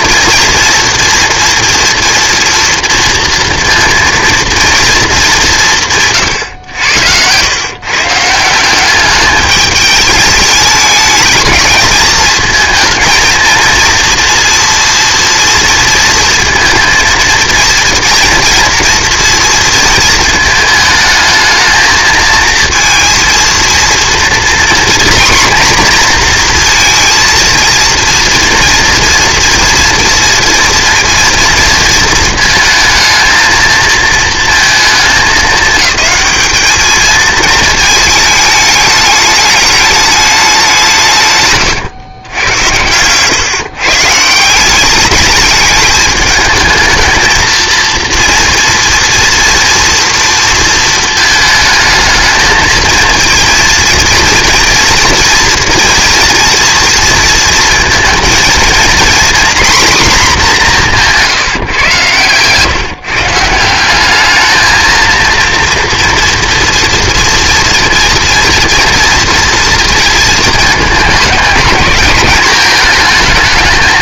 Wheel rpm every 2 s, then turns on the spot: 230, 240, 230, 100, 200, 210, 220, 230, 230, 240, 220, 230, 250, 230, 230, 230, 220, 220, 210, 210, 180, 100, 180, 220, 230, 230, 220, 230, 230, 230, 210, 140, 220, 230, 230, 220, 220.
6-8